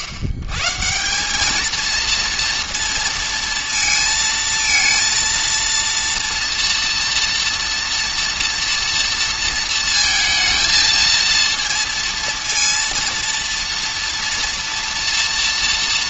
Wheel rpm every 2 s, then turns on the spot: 100, 230, 230, 230, 230, 220, 230, 230.
none